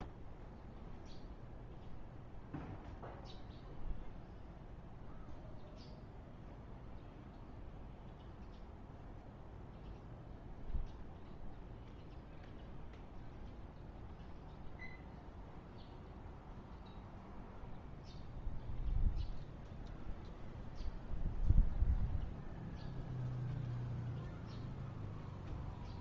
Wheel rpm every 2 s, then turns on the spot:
0, 0, 0, 0, 0, 0, 0, 0, 0, 0, 0, 0, 0.
none